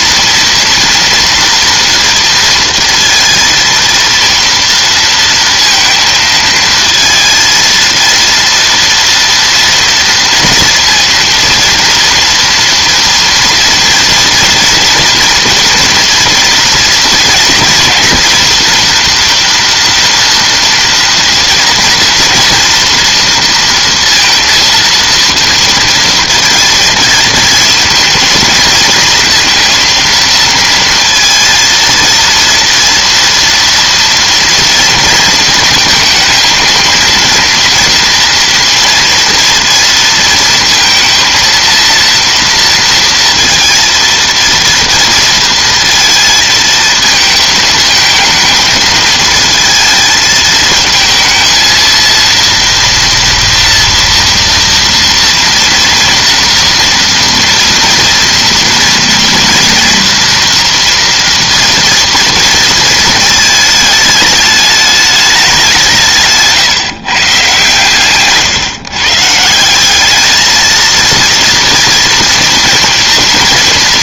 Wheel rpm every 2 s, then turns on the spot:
230, 230, 230, 220, 230, 230, 230, 230, 230, 230, 230, 230, 230, 230, 230, 230, 230, 230, 220, 230, 230, 230, 230, 230, 220, 220, 230, 240, 230, 230, 230, 230, 210, 140, 140, 220, 230.
68-70